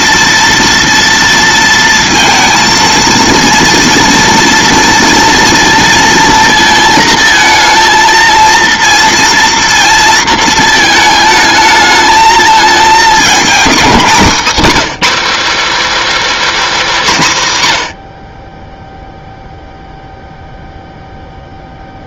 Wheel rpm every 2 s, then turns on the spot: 230, 230, 240, 230, 230, 220, 220, 240, 320, 80, 0.
none